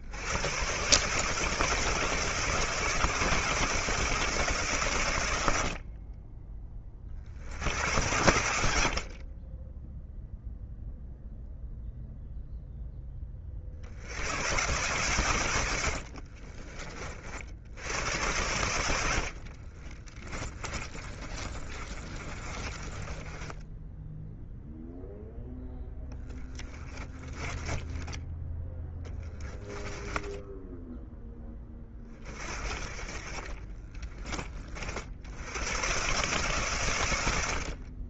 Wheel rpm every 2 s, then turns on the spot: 130, 160, 140, 30, 60, 0, 0, 110, 40, 90, 30, 30, 0, 30, 10, 10, 40, 40, 130.
20-24 26-28 30-32